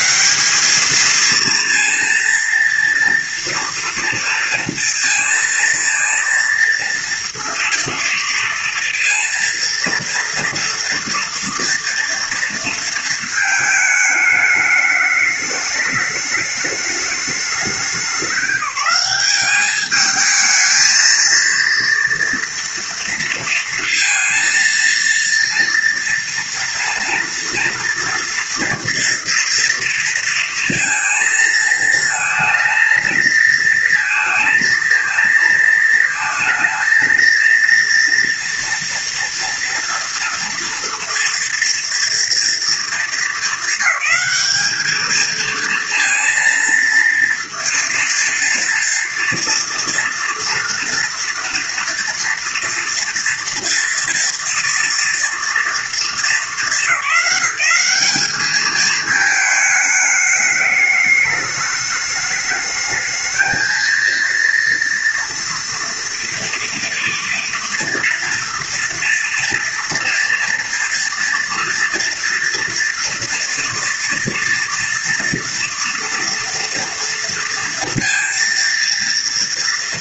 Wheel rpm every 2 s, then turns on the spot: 180, 230, 230, 230, 230, 230, 230, 210, 210, 190, 220, 230, 230, 230, 230, 230, 230, 220, 220, 230, 230, 230, 210, 230, 230, 230, 230, 230, 220, 210, 210, 210, 230, 240, 230, 230, 240, 230, 230, 230.
none